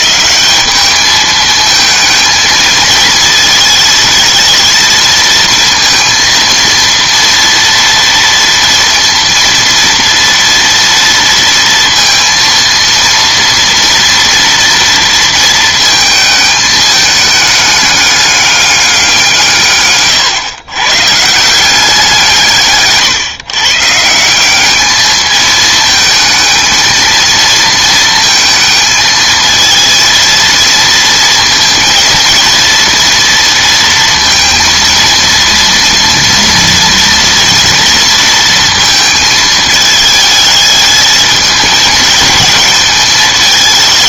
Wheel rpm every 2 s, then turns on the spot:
200, 220, 230, 230, 230, 230, 230, 230, 220, 200, 140, 160, 180, 220, 230, 230, 230, 230, 230, 230, 220, 220.
none